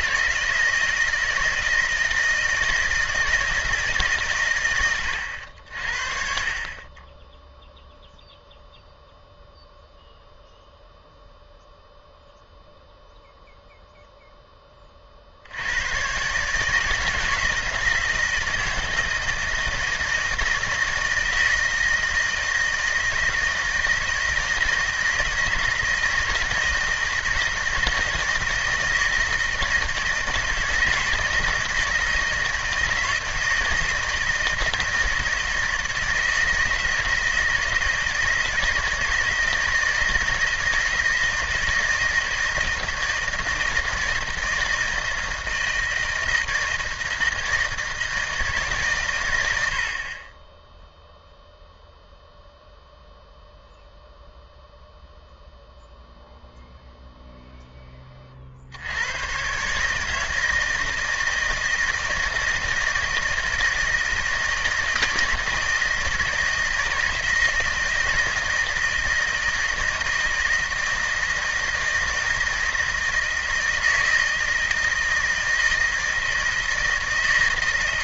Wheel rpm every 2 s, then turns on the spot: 160, 160, 120, 30, 0, 0, 0, 20, 150, 160, 160, 160, 170, 160, 160, 160, 160, 160, 160, 160, 160, 160, 160, 160, 140, 10, 0, 0, 0, 60, 160, 160, 160, 160, 160, 160, 160, 160, 160.
none